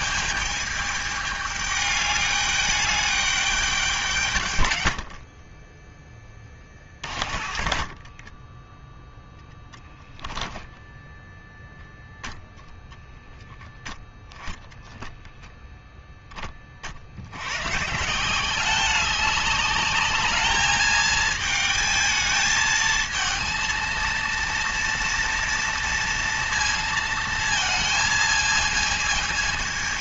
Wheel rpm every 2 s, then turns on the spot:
210, 210, 90, 30, 10, 10, 0, 10, 40, 190, 220, 230, 230, 230, 220.
4-10